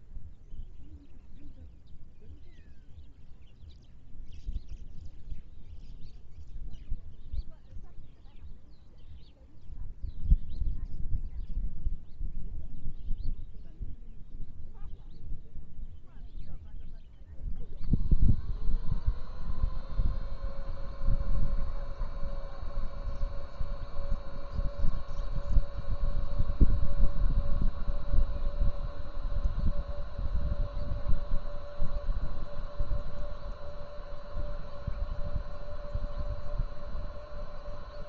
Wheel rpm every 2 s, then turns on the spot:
0, 0, 0, 0, 0, 0, 0, 0, 0, 0, 0, 0, 0, 0, 0, 0, 0, 0, 0.
none